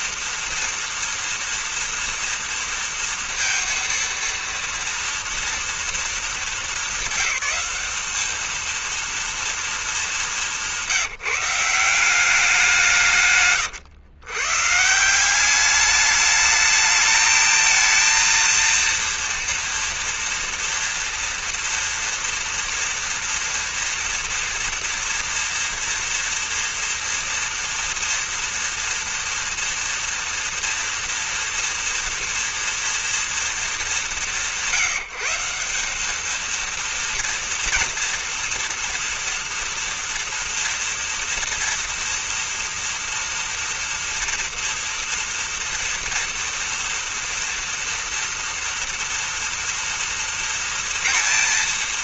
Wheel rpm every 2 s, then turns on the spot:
230, 230, 230, 220, 210, 210, 190, 120, 210, 230, 230, 230, 230, 230, 230, 230, 230, 180, 200, 230, 240, 230, 230, 230, 230, 230.
none